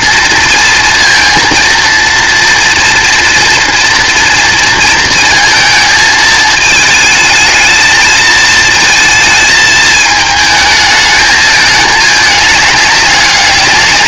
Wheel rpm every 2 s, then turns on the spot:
230, 240, 230, 220, 230, 220, 200.
none